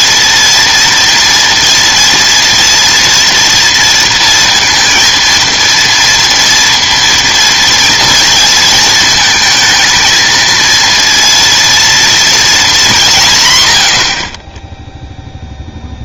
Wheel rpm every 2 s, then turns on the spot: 230, 230, 230, 230, 220, 230, 220, 20.
none